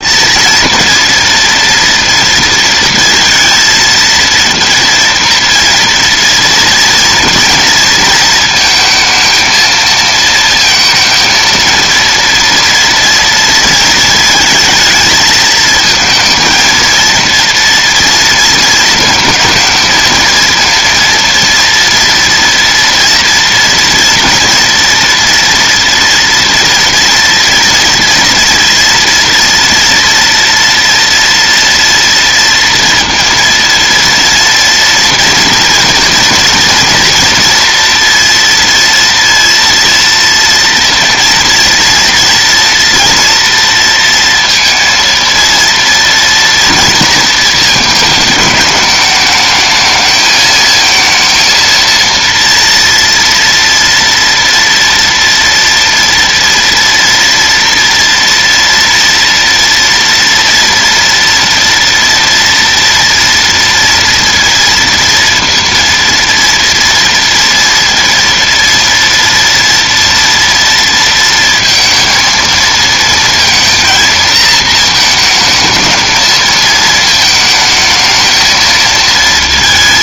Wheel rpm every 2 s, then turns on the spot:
230, 230, 230, 230, 220, 230, 230, 220, 230, 220, 230, 230, 230, 230, 230, 230, 230, 230, 230, 230, 230, 230, 230, 230, 210, 220, 240, 230, 230, 230, 240, 240, 230, 230, 230, 230, 220, 220, 220, 220.
none